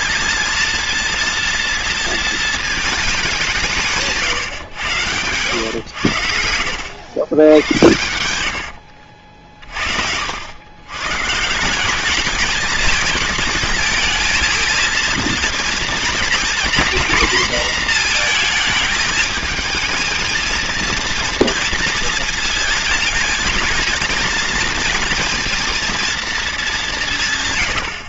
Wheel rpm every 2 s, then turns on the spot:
230, 220, 120, 90, 80, 100, 210, 220, 230, 220, 230, 230, 230, 200.
8-10